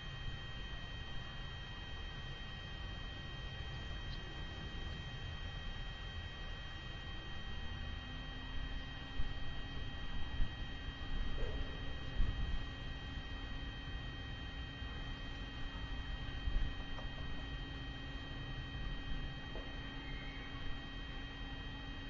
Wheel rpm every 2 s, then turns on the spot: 0, 0, 0, 0, 0, 0, 0, 0, 0, 0, 0.
none